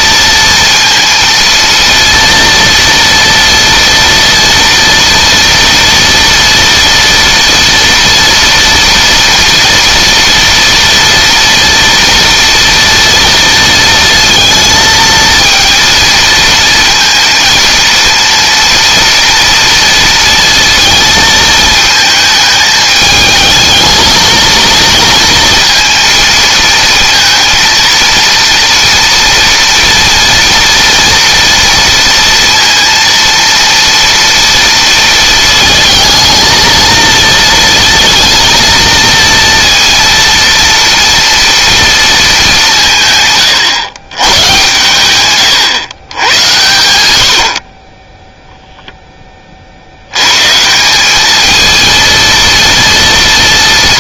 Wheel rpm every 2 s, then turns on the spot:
230, 230, 230, 230, 230, 230, 230, 230, 230, 230, 220, 220, 230, 230, 230, 240, 230, 230, 230, 230, 230, 160, 110, 100, 0, 170, 230.
none